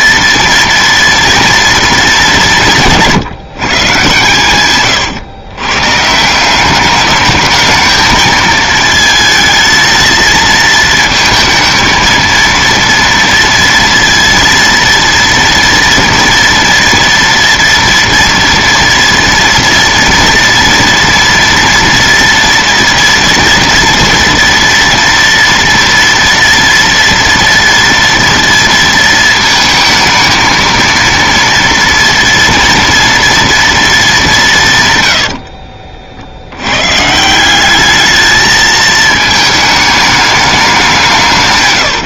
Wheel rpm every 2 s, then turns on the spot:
230, 190, 130, 170, 220, 220, 230, 230, 230, 230, 230, 230, 230, 230, 230, 220, 230, 190, 80, 220, 210.
none